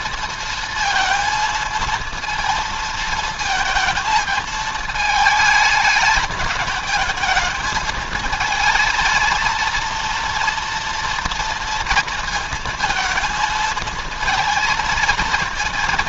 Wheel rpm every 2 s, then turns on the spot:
230, 230, 210, 220, 220, 230, 230, 230.
none